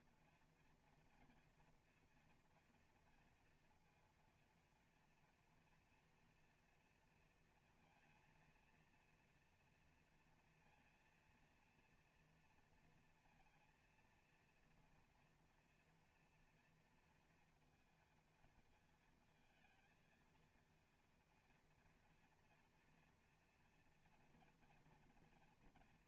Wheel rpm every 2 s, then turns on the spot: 230, 230, 230, 230, 230, 230, 230, 240, 230, 230, 230, 240, 220.
none